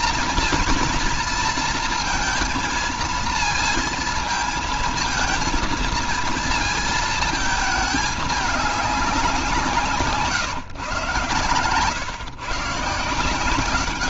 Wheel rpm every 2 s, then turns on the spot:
220, 220, 220, 220, 210, 140, 150.
none